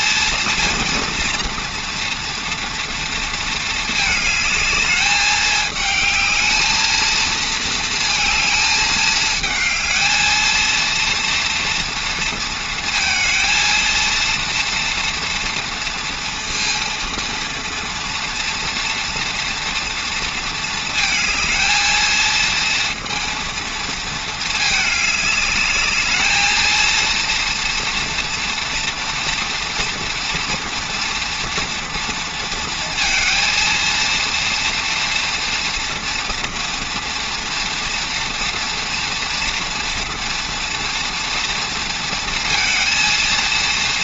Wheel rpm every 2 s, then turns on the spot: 230, 230, 210, 220, 220, 230, 230, 230, 230, 230, 220, 230, 220, 230, 230, 230, 230, 230, 240, 240, 230, 220.
none